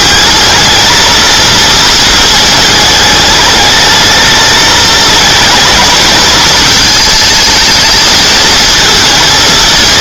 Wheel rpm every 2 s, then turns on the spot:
220, 220, 210, 220, 220.
none